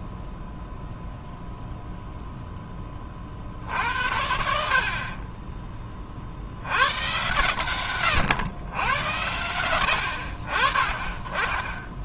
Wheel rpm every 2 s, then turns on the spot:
0, 10, 50, 100, 100, 30.
none